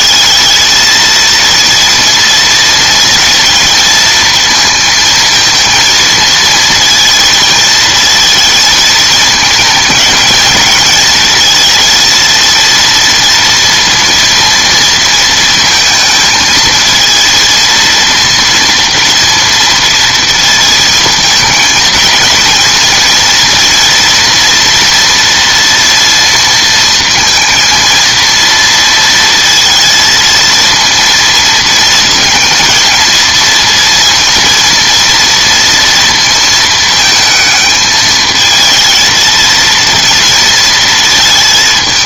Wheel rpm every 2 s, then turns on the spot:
220, 230, 230, 230, 230, 220, 230, 230, 220, 230, 230, 230, 230, 230, 230, 230, 220, 230, 230, 220, 230.
none